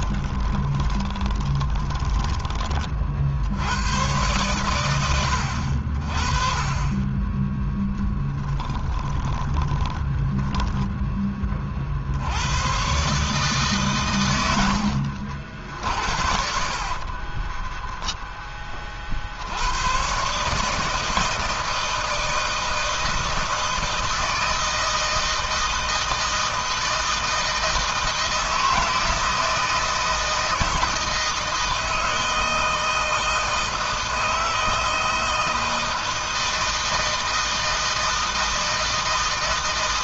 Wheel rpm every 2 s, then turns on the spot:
10, 20, 120, 30, 10, 10, 100, 110, 60, 20, 140, 160, 160, 160, 160, 160, 160, 160, 160, 160.
0-2 8-12 16-18